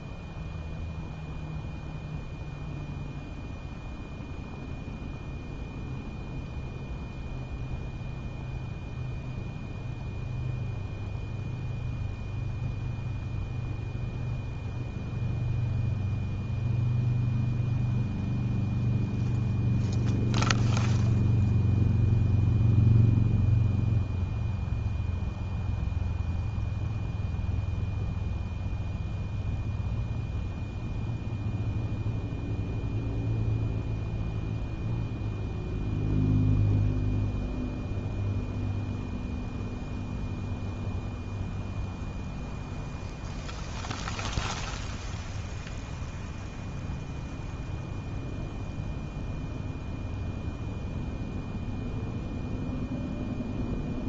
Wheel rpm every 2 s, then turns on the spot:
0, 0, 0, 0, 0, 0, 0, 0, 0, 0, 0, 0, 0, 0, 0, 0, 0, 0, 0, 0, 0, 0, 0, 0, 0, 0, 0.
none